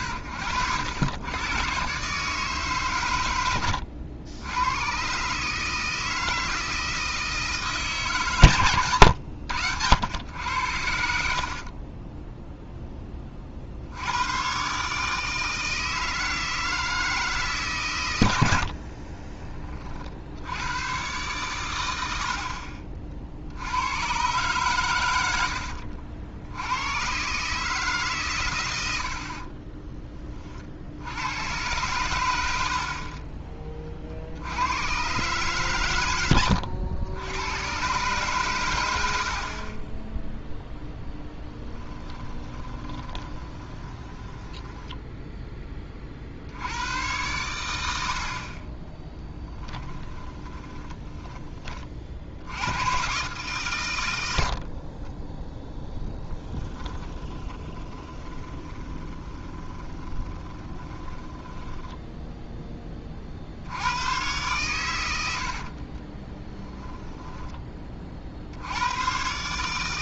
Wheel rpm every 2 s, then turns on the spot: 90, 140, 110, 160, 120, 80, 10, 140, 160, 60, 110, 50, 120, 100, 90, 50, 40, 100, 90, 100, 0, 20, 10, 90, 30, 20, 100, 50, 20, 20, 30, 20, 110, 10, 90.
18-20 42-46 50-52 54-62